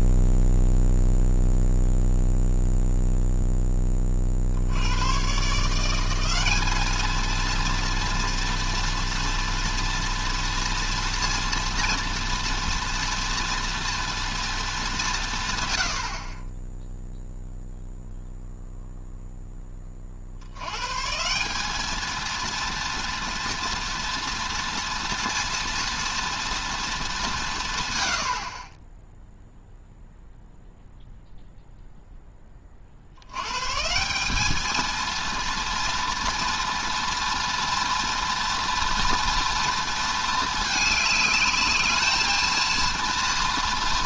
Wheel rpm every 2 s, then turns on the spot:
0, 0, 90, 210, 230, 230, 240, 200, 10, 0, 130, 230, 240, 230, 30, 0, 40, 230, 230, 230, 220, 230.
none